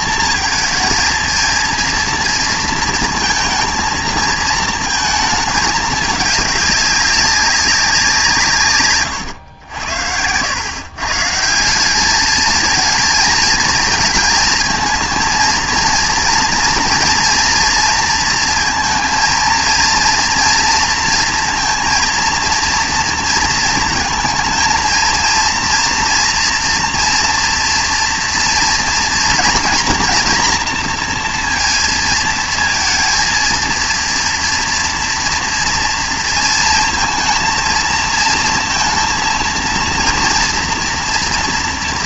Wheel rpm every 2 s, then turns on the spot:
230, 230, 220, 200, 140, 110, 220, 220, 230, 230, 230, 230, 220, 230, 230, 230, 230, 230, 230, 230, 230.
none